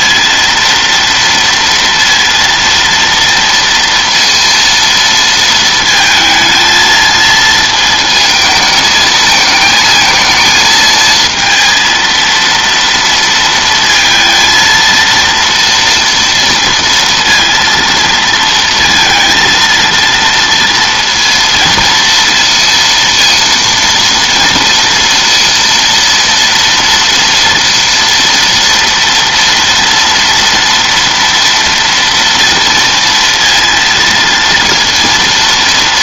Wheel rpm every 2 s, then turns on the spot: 230, 230, 230, 220, 220, 220, 230, 230, 230, 230, 230, 230, 230, 230, 230, 230, 230, 230.
none